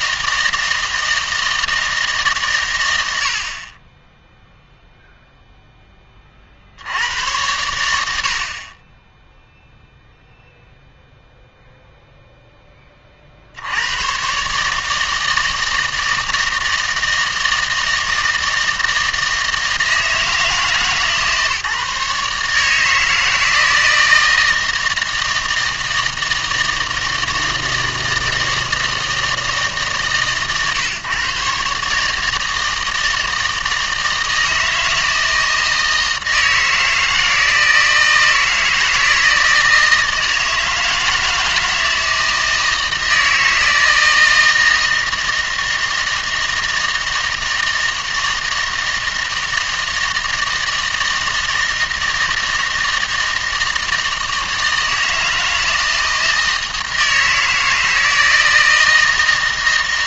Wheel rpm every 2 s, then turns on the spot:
160, 110, 0, 70, 40, 0, 20, 150, 160, 160, 150, 150, 160, 160, 160, 130, 160, 160, 160, 160, 160, 160, 160, 160, 160, 160, 160, 160, 160, 160.
none